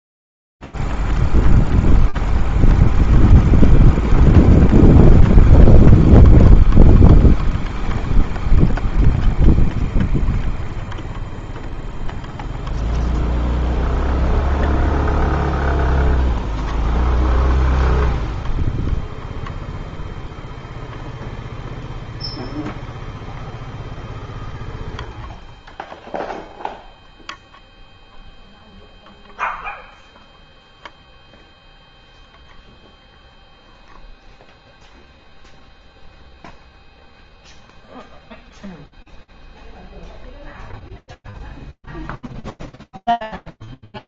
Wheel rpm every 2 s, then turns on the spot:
0, 0, 0, 0, 0, 0, 0, 0, 0, 0, 0, 0, 0, 0, 0, 0, 0, 0, 0, 0, 0, 0.
none